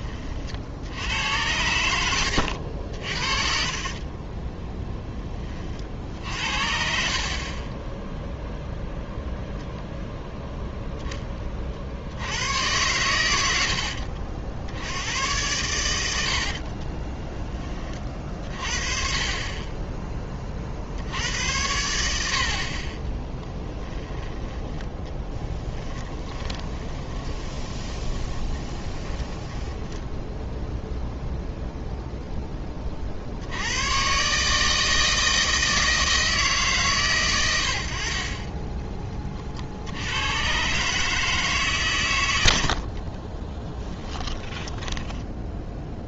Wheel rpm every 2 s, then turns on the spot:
60, 70, 10, 60, 0, 0, 110, 70, 50, 40, 60, 30, 10, 10, 20, 0, 40, 160, 130, 10, 130, 70, 10.
2-4 16-18 26-30 44-46